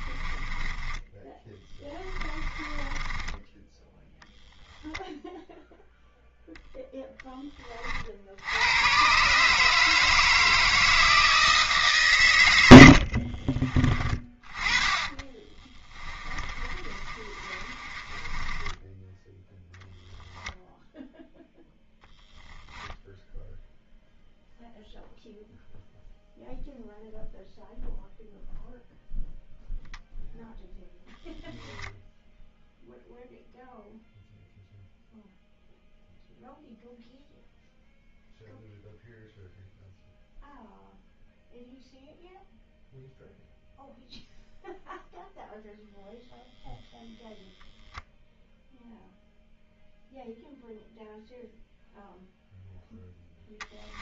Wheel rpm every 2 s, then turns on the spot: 20, 10, 0, 0, 100, 160, 60, 30, 30, 10, 0, 10, 0, 0, 0, 0, 0, 0, 0, 0, 0, 0, 0, 0, 0, 0, 0.
0-4 12-20